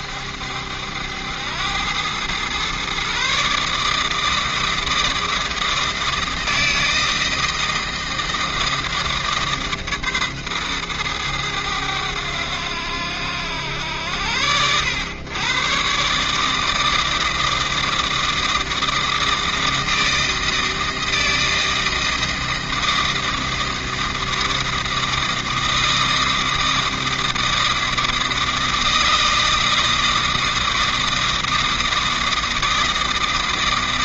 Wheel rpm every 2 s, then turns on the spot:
90, 140, 160, 160, 150, 110, 90, 110, 160, 160, 160, 160, 160, 160, 160, 160, 160.
none